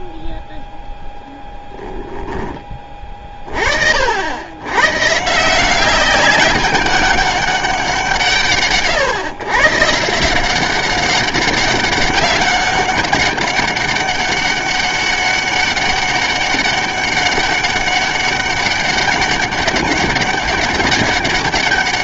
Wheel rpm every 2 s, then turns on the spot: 0, 20, 110, 200, 140, 190, 200, 200, 200, 200, 200.
none